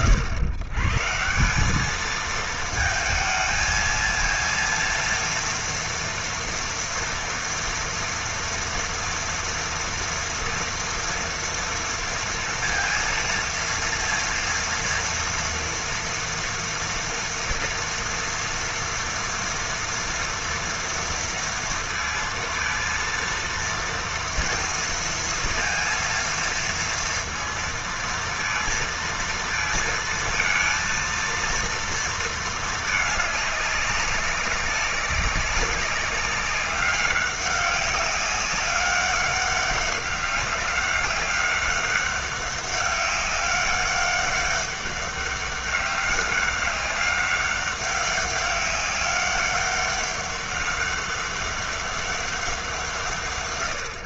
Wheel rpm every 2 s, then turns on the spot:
120, 220, 230, 230, 230, 230, 230, 230, 230, 230, 230, 230, 230, 230, 230, 230, 210, 200, 200, 200, 200, 200, 200, 200, 200, 200, 150.
none